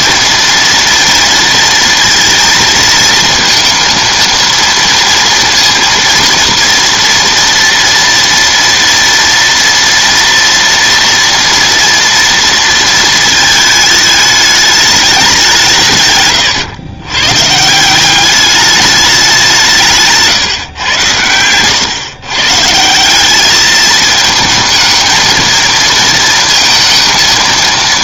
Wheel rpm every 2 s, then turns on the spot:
230, 230, 230, 230, 230, 240, 220, 190, 110, 190, 110, 190, 220, 220.
none